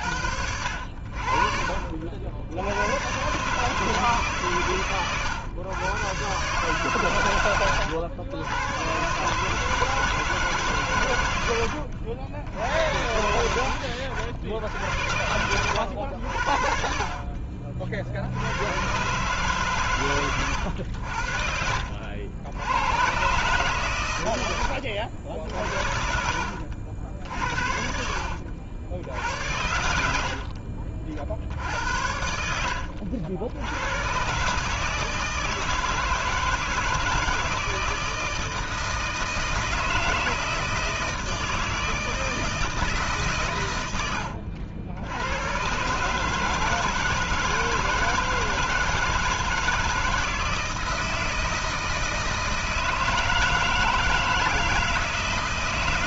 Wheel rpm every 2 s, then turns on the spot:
70, 70, 130, 140, 110, 140, 90, 80, 60, 90, 100, 80, 90, 80, 80, 40, 80, 150, 160, 160, 160, 160, 90, 160, 160, 160, 160, 160.
32-34